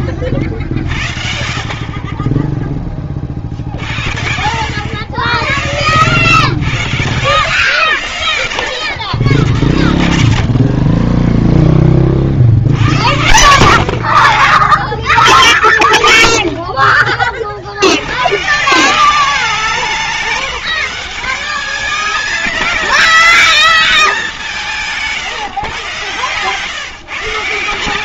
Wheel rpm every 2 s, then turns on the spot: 90, 20, 70, 120, 130, 90, 70, 30, 30, 130, 180, 220, 190, 140.
none